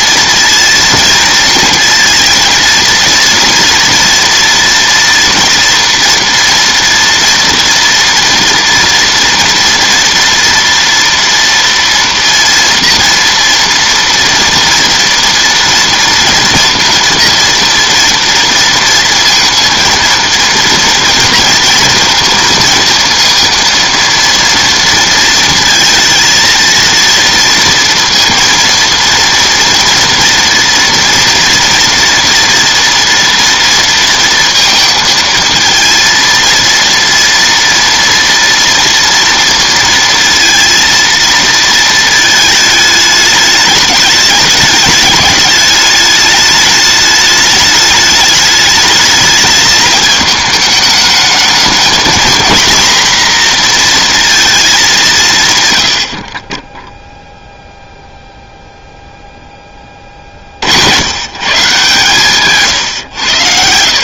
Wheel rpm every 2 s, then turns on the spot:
230, 230, 230, 230, 230, 230, 230, 230, 230, 230, 230, 230, 230, 230, 230, 230, 230, 230, 230, 230, 230, 220, 210, 210, 210, 220, 230, 220, 20, 0, 50, 140.
none